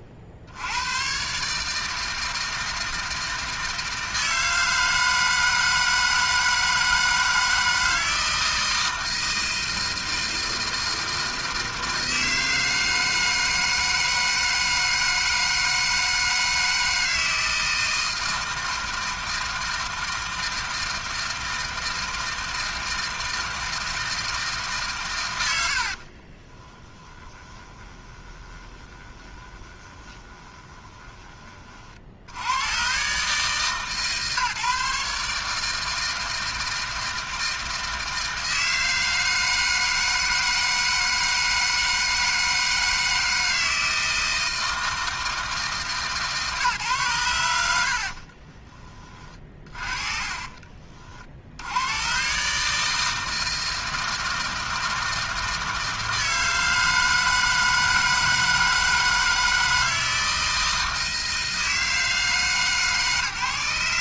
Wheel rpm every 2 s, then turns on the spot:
50, 160, 160, 160, 160, 160, 160, 160, 160, 160, 160, 160, 140, 30, 20, 20, 90, 150, 160, 160, 160, 160, 160, 150, 40, 40, 140, 160, 160, 160, 160, 150.
26-32 48-50